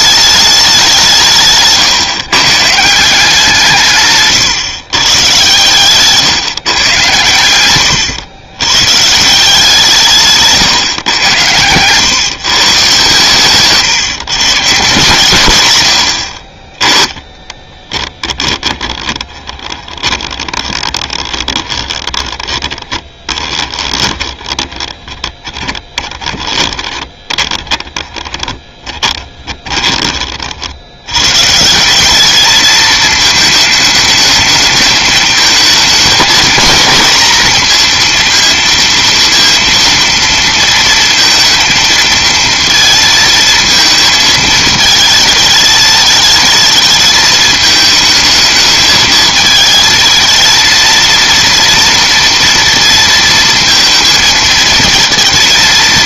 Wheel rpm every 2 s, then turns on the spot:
200, 170, 130, 140, 120, 140, 140, 140, 20, 10, 20, 20, 20, 30, 20, 70, 220, 220, 230, 230, 230, 230, 220, 220, 220, 220, 230, 220.
18-30